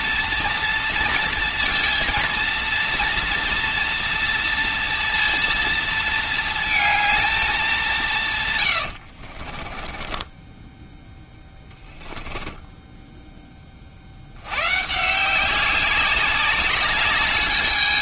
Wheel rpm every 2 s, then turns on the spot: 230, 230, 230, 220, 80, 10, 10, 120, 200.
8-10